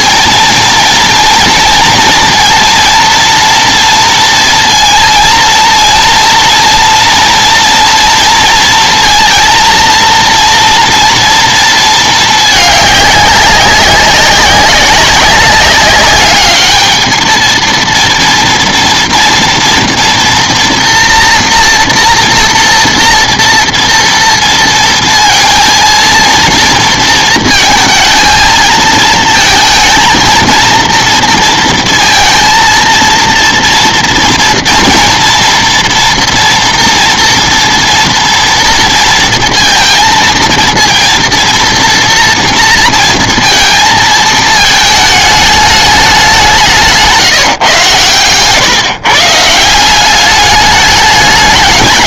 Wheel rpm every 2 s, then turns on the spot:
230, 230, 230, 230, 230, 230, 210, 200, 210, 230, 230, 230, 230, 230, 230, 230, 230, 230, 230, 230, 230, 230, 220, 180, 130, 210.
none